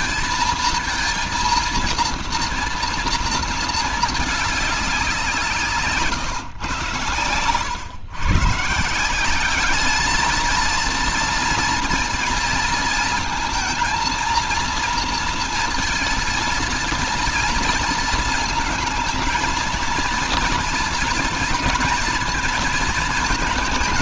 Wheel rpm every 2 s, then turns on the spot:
230, 230, 200, 120, 160, 230, 230, 230, 230, 220, 230, 230.
none